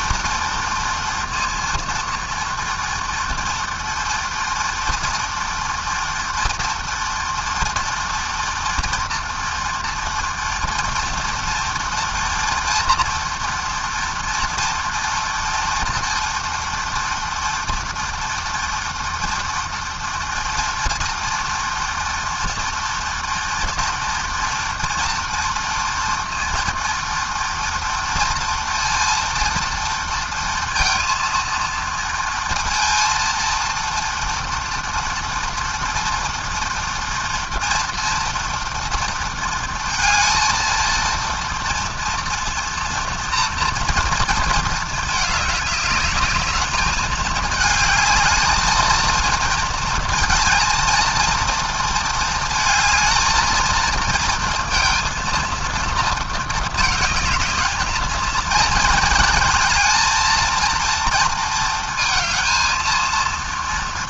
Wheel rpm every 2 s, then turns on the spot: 230, 230, 230, 230, 230, 240, 240, 230, 230, 230, 230, 240, 240, 230, 230, 230, 230, 230, 230, 230, 230, 230, 210, 220, 230, 230, 220, 230, 220, 230, 230, 230.
none